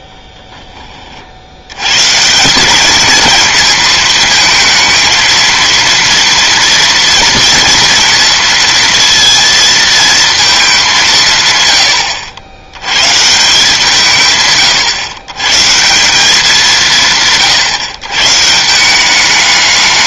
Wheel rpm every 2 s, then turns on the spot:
10, 170, 220, 230, 230, 210, 90, 130, 190, 160.
none